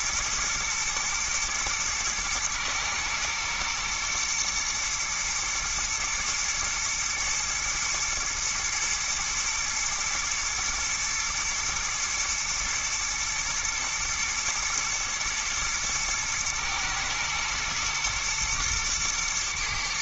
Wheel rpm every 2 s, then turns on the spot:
110, 110, 120, 120, 110, 120, 120, 110, 110, 110.
none